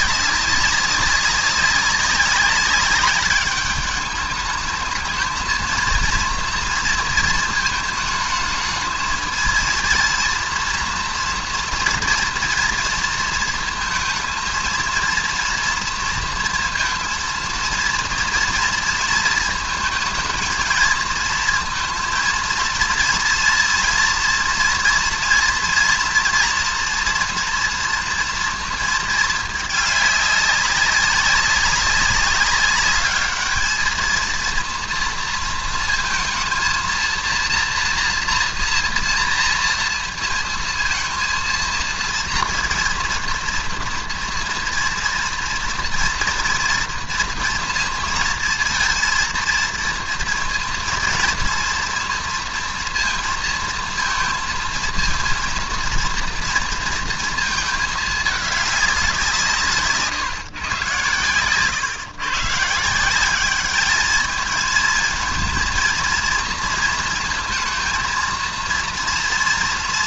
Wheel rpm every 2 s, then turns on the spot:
200, 200, 220, 230, 220, 230, 230, 230, 230, 230, 230, 230, 230, 230, 230, 200, 200, 230, 230, 230, 230, 240, 230, 230, 230, 230, 230, 230, 230, 200, 120, 160, 220, 230, 230.
none